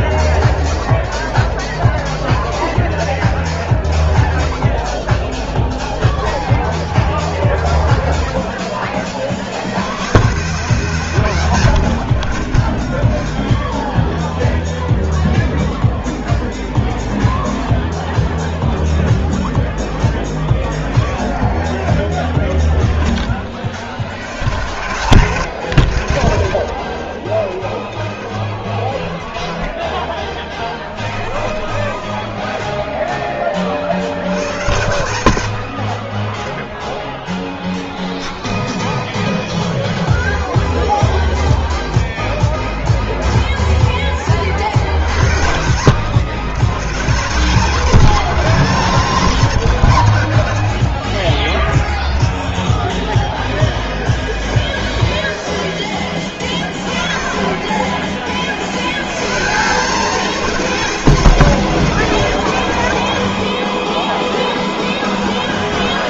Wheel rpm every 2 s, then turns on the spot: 0, 10, 0, 0, 10, 130, 30, 0, 0, 0, 10, 20, 100, 60, 10, 20, 10, 100, 0, 0, 0, 0, 50, 130, 210, 80, 0, 0, 20, 50, 210, 130, 30.
12-14